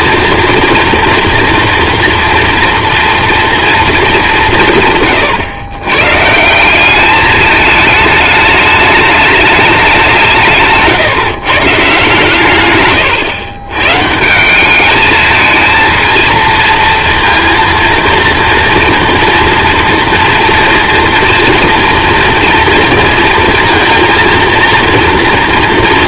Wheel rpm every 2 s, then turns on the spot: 230, 230, 180, 170, 210, 160, 130, 170, 230, 230, 230, 240, 230.
none